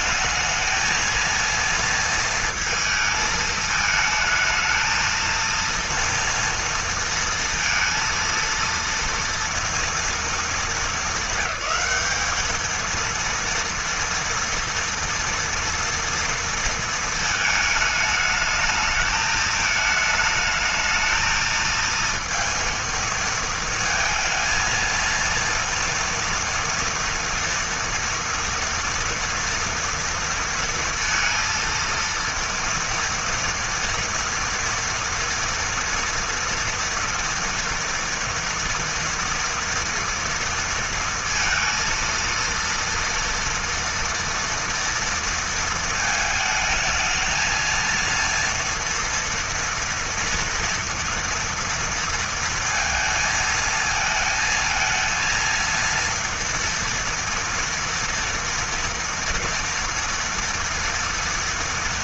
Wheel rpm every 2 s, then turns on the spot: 230, 220, 230, 230, 230, 200, 230, 230, 220, 220, 220, 230, 230, 230, 230, 230, 230, 230, 230, 230, 230, 230, 230, 220, 230, 230, 230, 230, 230, 230, 230.
none